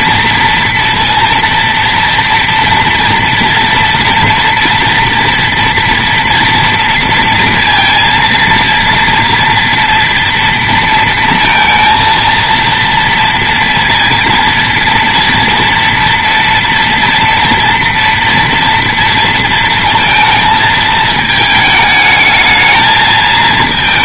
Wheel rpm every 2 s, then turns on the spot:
230, 230, 230, 230, 230, 230, 230, 230, 230, 230, 220, 220.
none